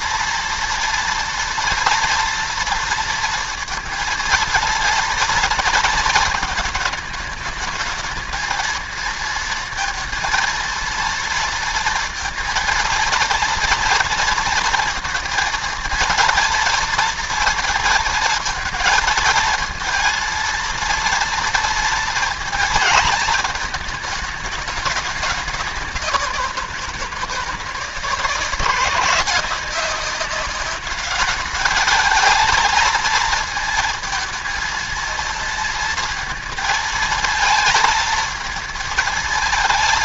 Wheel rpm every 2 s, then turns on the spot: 230, 230, 230, 220, 230, 230, 230, 230, 230, 230, 230, 230, 220, 170, 170, 200, 220, 230, 230, 230.
none